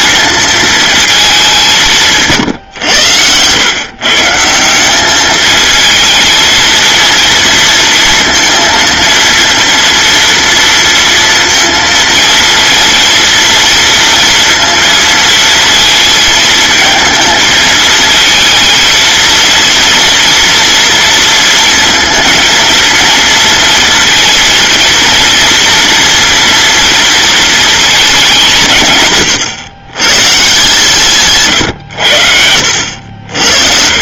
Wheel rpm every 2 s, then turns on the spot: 230, 120, 180, 230, 230, 230, 230, 230, 220, 230, 230, 230, 230, 230, 160, 160, 70.
none